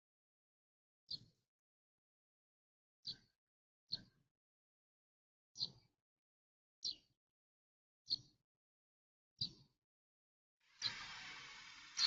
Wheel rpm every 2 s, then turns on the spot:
0, 0, 0, 0, 0, 0.
none